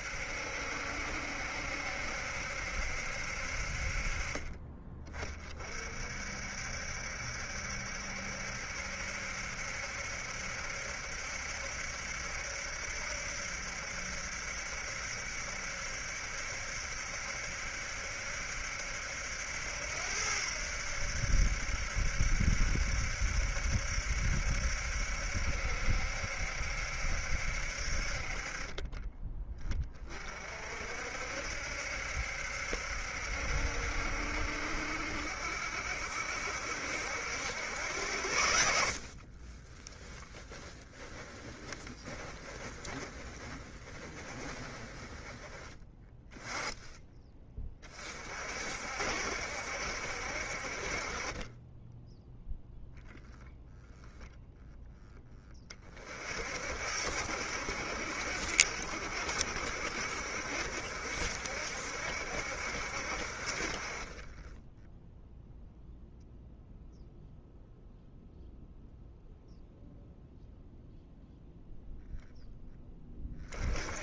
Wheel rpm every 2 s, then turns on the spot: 70, 70, 30, 60, 70, 70, 70, 70, 70, 70, 80, 70, 70, 70, 30, 50, 70, 60, 70, 80, 10, 20, 20, 10, 60, 60, 0, 0, 50, 60, 60, 70, 20, 0, 0, 0, 10.
38-46